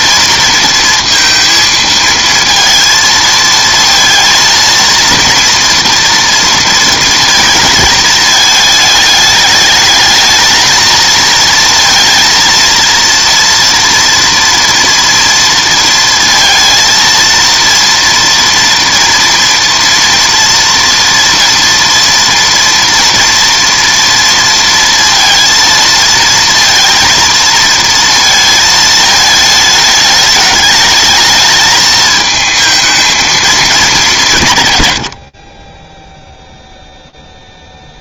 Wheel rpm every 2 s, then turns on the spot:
230, 230, 230, 230, 210, 220, 230, 230, 230, 230, 240, 240, 230, 230, 220, 210, 220, 140, 0.
none